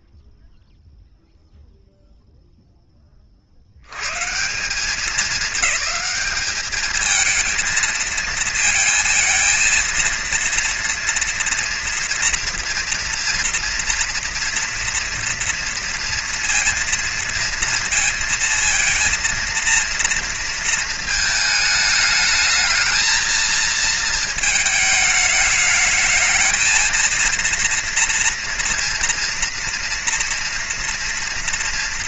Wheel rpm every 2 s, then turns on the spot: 0, 0, 110, 210, 220, 230, 240, 240, 240, 230, 230, 210, 220, 220, 230, 230.
none